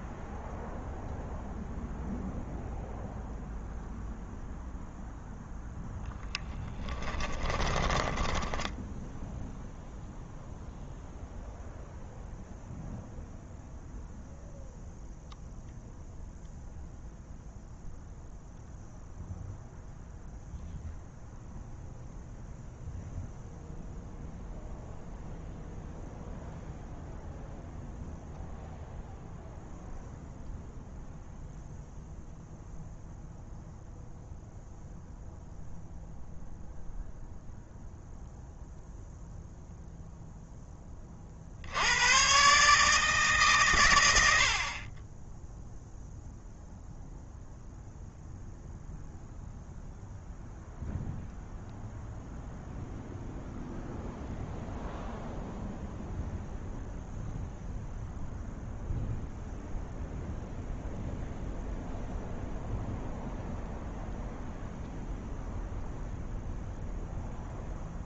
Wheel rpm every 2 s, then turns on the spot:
0, 0, 0, 10, 10, 0, 0, 0, 0, 0, 0, 0, 0, 0, 0, 0, 0, 0, 0, 0, 20, 150, 30, 0, 0, 0, 0, 0, 0, 0, 0, 0, 0, 0.
6-10